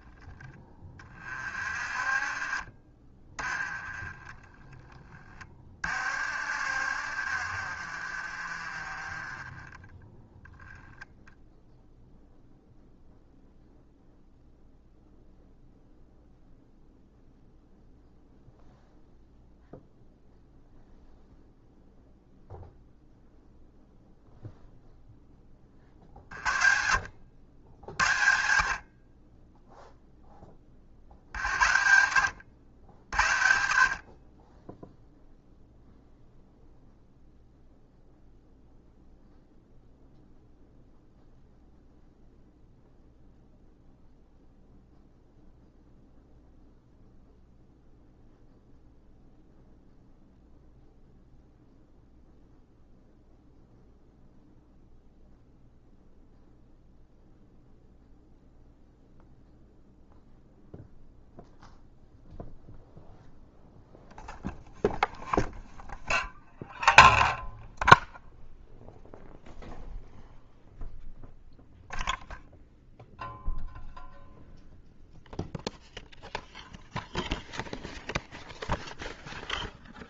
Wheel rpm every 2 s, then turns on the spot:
30, 30, 20, 60, 30, 0, 0, 0, 0, 0, 0, 0, 0, 70, 40, 50, 80, 0, 0, 0, 0, 0, 0, 0, 0, 0, 0, 0, 0, 0, 0, 0, 0, 0, 0, 0, 0, 0, 0, 0.
0-2 4-10